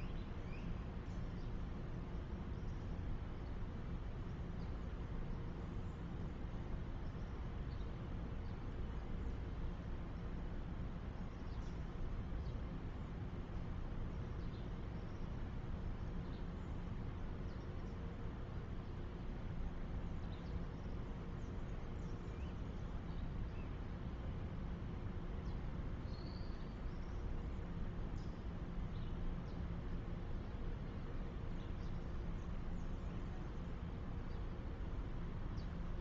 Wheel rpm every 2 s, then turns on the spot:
0, 0, 0, 0, 0, 0, 0, 0, 0, 0, 0, 0, 0, 0, 0, 0, 0, 0.
none